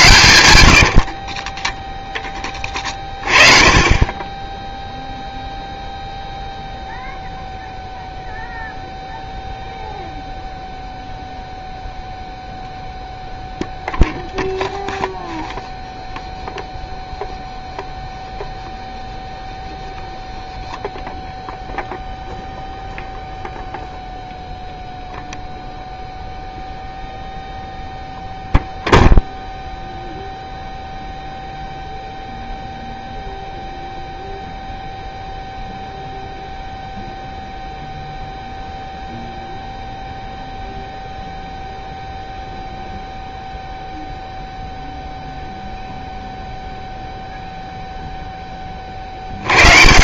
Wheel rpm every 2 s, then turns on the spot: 50, 30, 0, 0, 0, 0, 0, 0, 0, 0, 0, 0, 0, 0, 0, 0, 0, 0, 0, 0, 0, 0, 0, 0, 40.
0-2